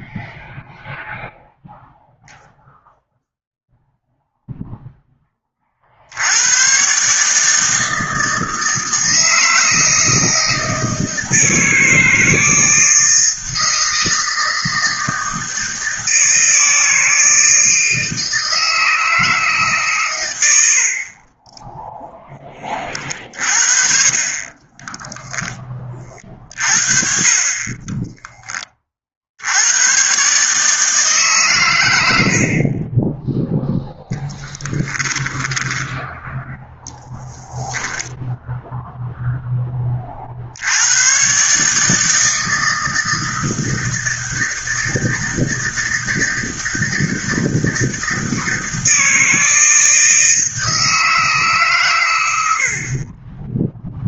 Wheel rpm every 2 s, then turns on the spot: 0, 0, 10, 140, 160, 160, 160, 160, 160, 160, 60, 30, 10, 40, 50, 140, 20, 10, 10, 0, 120, 160, 160, 160, 160, 160, 30.
20-22 34-38